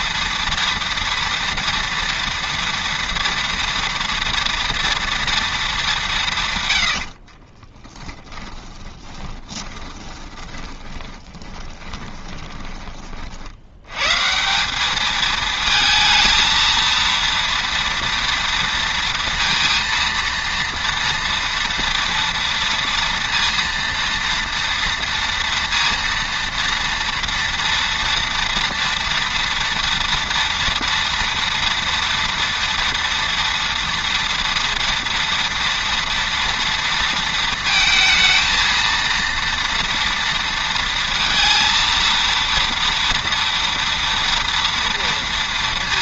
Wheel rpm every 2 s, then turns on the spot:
230, 230, 230, 100, 30, 10, 20, 190, 230, 230, 230, 230, 230, 230, 230, 230, 230, 230, 230, 230, 230, 230, 230.
6-14